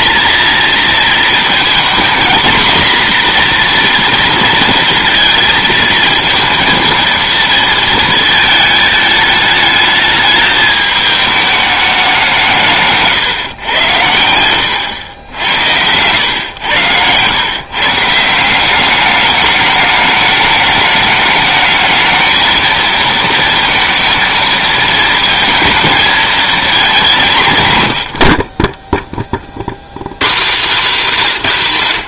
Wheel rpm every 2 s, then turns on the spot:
230, 240, 230, 230, 220, 220, 160, 100, 100, 180, 210, 220, 220, 230, 40, 180.
14-16 28-30